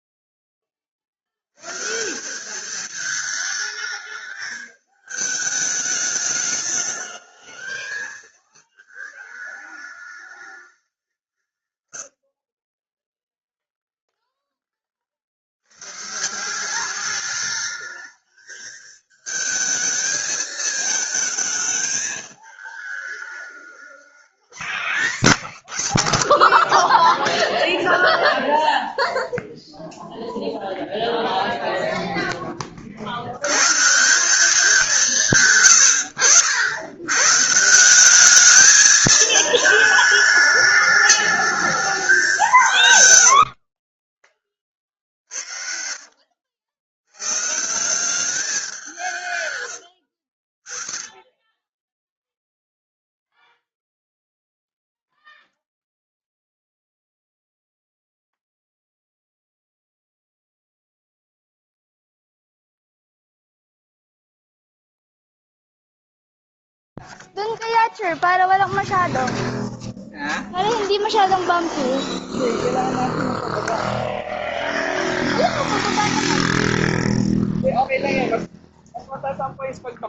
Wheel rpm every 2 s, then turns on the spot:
30, 210, 220, 210, 220, 200, 40, 40, 190, 220, 220, 210, 190, 20, 0, 0, 30, 180, 80, 210, 210, 170, 50, 80, 190, 50, 0, 0, 0, 0, 0, 0, 0, 0, 0, 0, 0, 0, 0, 0.
12-14